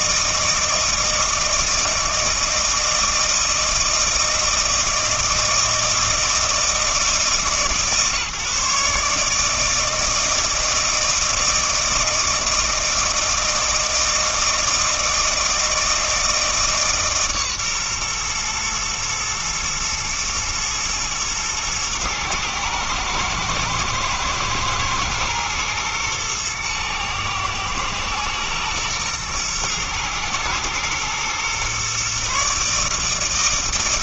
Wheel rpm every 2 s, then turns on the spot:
160, 160, 160, 160, 150, 160, 160, 160, 150, 120, 120, 110, 110, 120, 120, 110, 150.
none